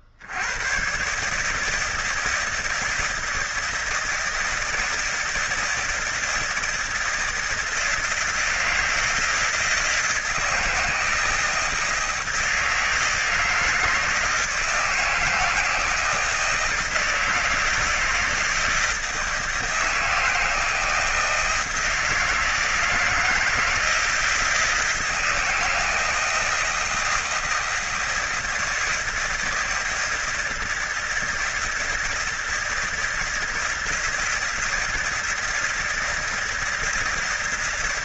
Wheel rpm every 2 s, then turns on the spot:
70, 160, 160, 160, 160, 160, 160, 160, 160, 160, 160, 160, 160, 160, 160, 160, 160, 160, 160.
none